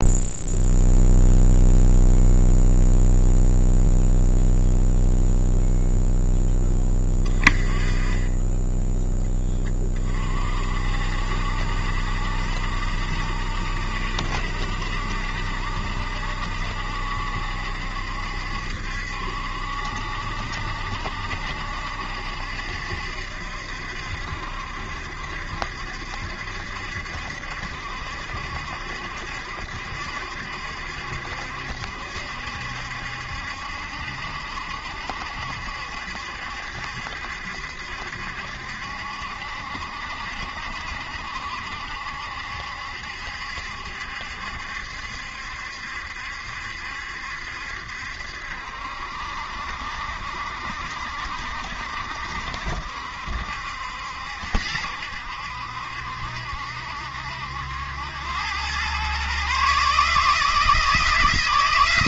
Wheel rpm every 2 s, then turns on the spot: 0, 0, 0, 10, 10, 50, 70, 70, 70, 70, 70, 70, 70, 70, 70, 70, 70, 70, 70, 70, 70, 70, 70, 70, 70, 70, 60, 70, 70, 100, 160.
none